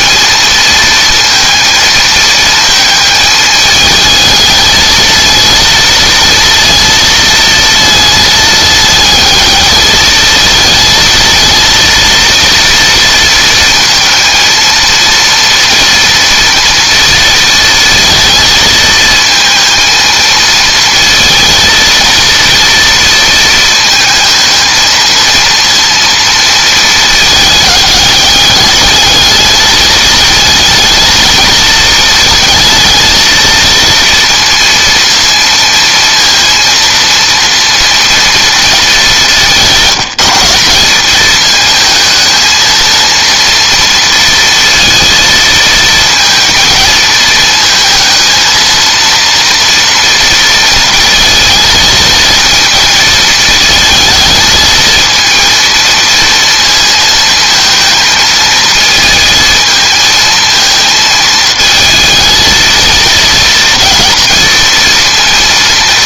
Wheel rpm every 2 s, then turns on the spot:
230, 220, 220, 230, 220, 230, 230, 230, 230, 230, 230, 230, 230, 220, 210, 220, 230, 230, 230, 210, 190, 230, 230, 230, 230, 230, 230, 220, 230, 220, 230, 230, 230.
none